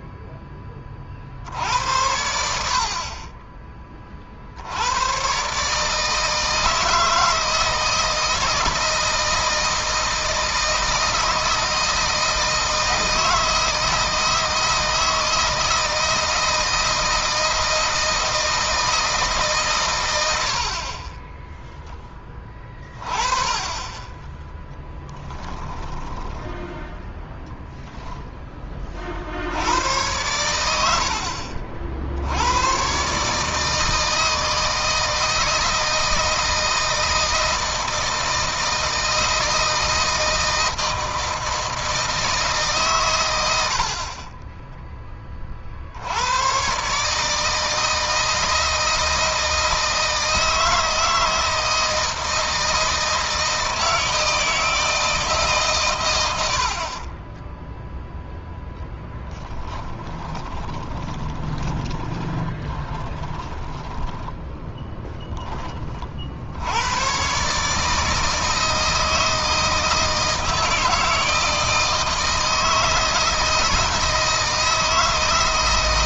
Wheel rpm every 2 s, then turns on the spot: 10, 70, 90, 160, 170, 160, 160, 160, 160, 160, 40, 20, 10, 10, 30, 80, 110, 160, 160, 160, 160, 140, 20, 130, 160, 160, 160, 160, 60, 0, 20, 20, 20, 90, 160, 160, 160, 160.
24-26 60-66